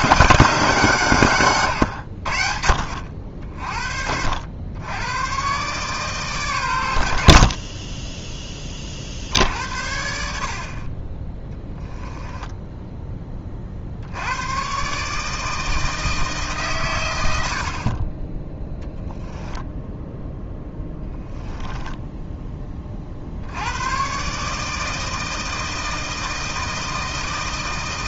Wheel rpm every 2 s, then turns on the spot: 170, 70, 90, 120, 20, 50, 10, 130, 140, 10, 10, 20, 150, 160.
20-22